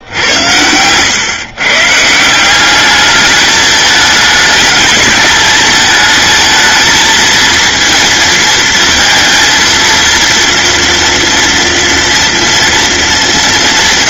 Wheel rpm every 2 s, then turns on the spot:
100, 200, 210, 220, 230, 230, 190.
none